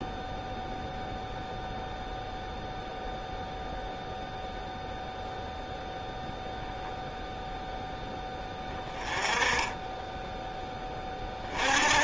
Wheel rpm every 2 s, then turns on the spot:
0, 0, 0, 0, 10, 10.
none